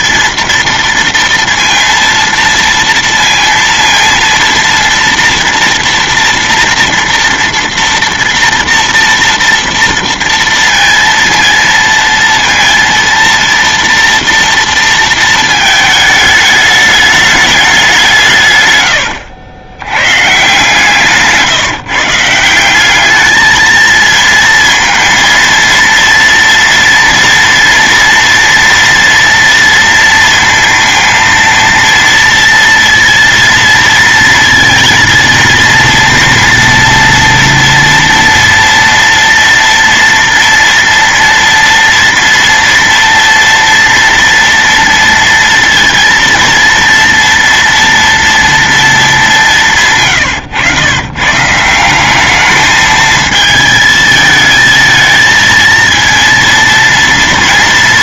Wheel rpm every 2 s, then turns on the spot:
230, 230, 230, 230, 230, 230, 230, 230, 210, 120, 150, 180, 230, 230, 230, 230, 230, 230, 230, 230, 230, 230, 230, 230, 230, 120, 210, 220, 230.
none